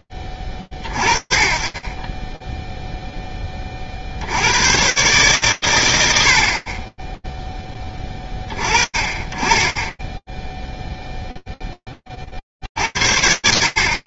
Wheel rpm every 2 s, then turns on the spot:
50, 0, 130, 10, 30, 0, 50.
none